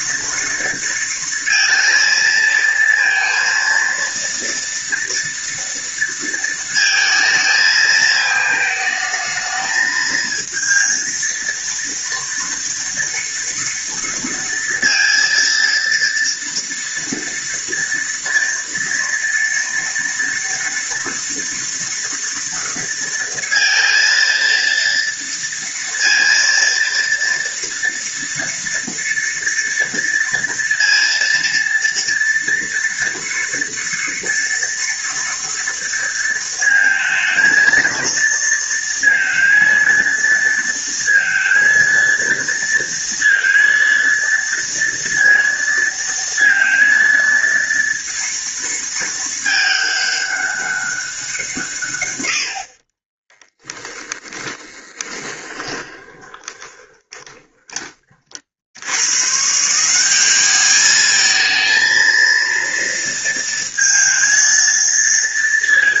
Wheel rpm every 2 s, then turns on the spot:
230, 230, 230, 230, 220, 230, 230, 230, 230, 230, 230, 230, 230, 230, 230, 230, 230, 230, 220, 230, 230, 230, 230, 230, 220, 180, 30, 20, 30, 110, 220, 230, 230.
52-58